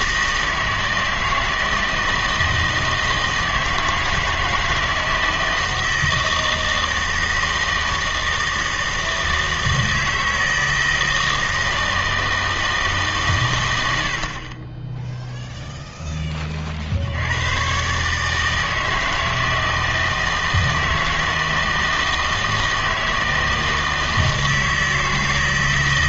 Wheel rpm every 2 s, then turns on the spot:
160, 160, 160, 160, 160, 160, 160, 20, 50, 160, 160, 160, 160.
none